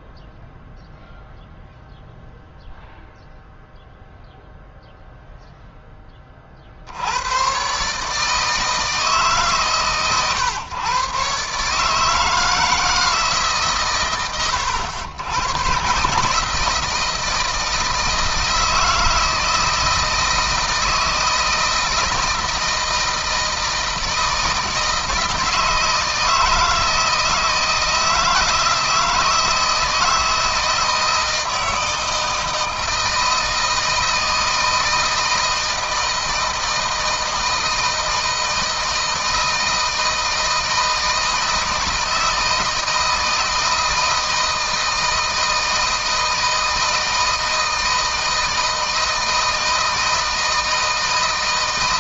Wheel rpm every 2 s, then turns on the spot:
0, 0, 0, 70, 160, 130, 160, 100, 160, 160, 160, 160, 160, 160, 160, 160, 160, 160, 160, 160, 160, 160, 160, 160, 160, 160.
none